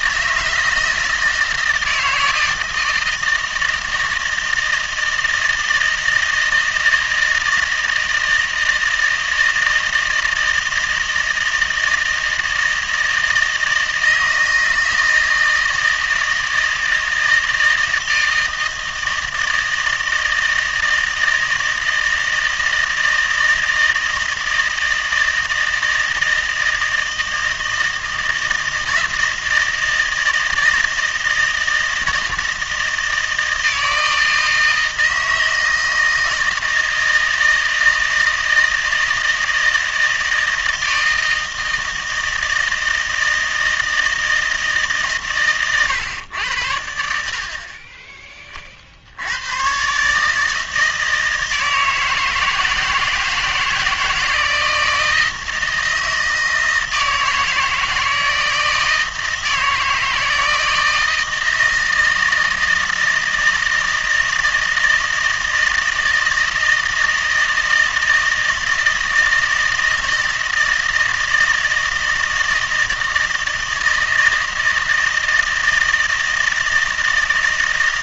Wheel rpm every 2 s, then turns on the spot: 160, 160, 160, 160, 160, 160, 160, 160, 160, 160, 160, 160, 160, 160, 160, 160, 160, 160, 160, 160, 160, 160, 150, 90, 50, 160, 160, 160, 160, 160, 160, 160, 160, 160, 160, 160, 160, 160, 160.
none